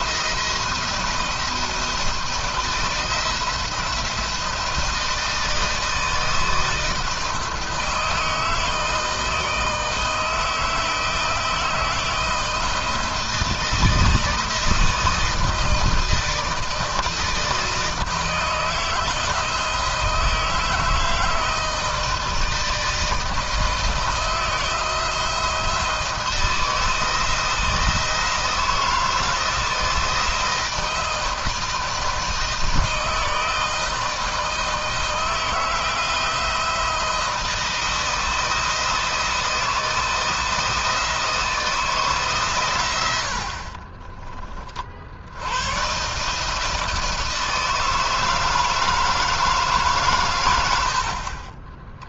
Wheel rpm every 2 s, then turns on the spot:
170, 170, 160, 160, 160, 160, 160, 160, 160, 160, 160, 160, 170, 170, 160, 160, 160, 160, 170, 160, 170, 100, 60, 160, 160, 60.
none